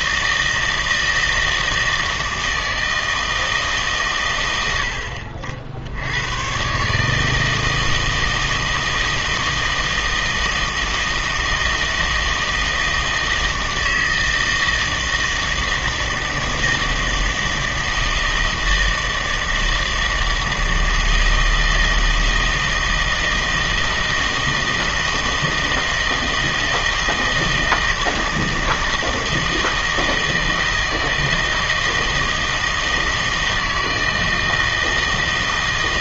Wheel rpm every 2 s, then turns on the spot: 160, 160, 90, 130, 160, 160, 160, 160, 160, 160, 160, 160, 160, 160, 160, 160, 160, 160.
none